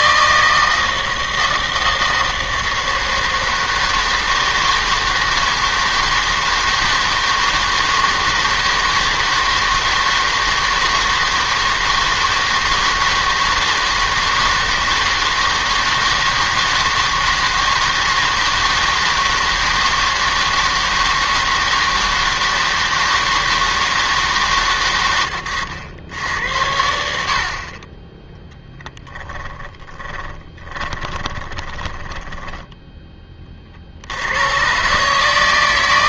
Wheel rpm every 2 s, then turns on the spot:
160, 160, 160, 160, 160, 160, 160, 160, 160, 160, 160, 160, 130, 90, 10, 30, 10, 110.
28-34